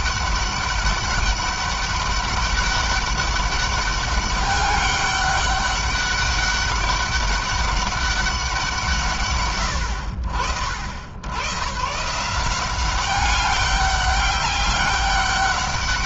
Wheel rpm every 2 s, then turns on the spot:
200, 200, 200, 200, 170, 110, 190, 200.
none